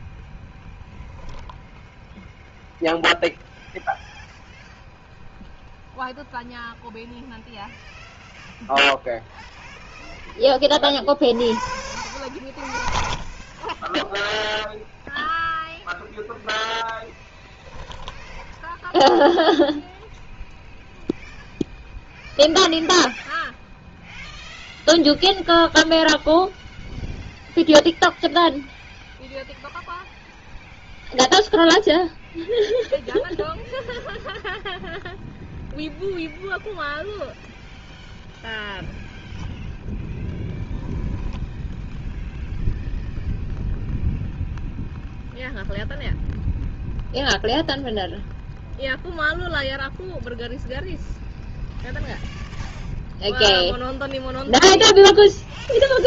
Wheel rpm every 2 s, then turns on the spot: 0, 0, 0, 0, 0, 30, 60, 0, 10, 10, 0, 0, 0, 0, 0, 0, 0, 0, 0, 0, 10, 0, 0, 0, 0, 0, 0, 0.
18-20 40-42